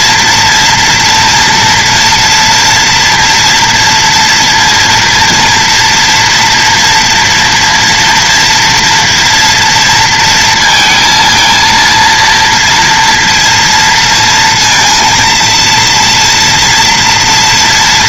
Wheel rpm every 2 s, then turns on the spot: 230, 230, 240, 230, 230, 230, 230, 230, 230.
none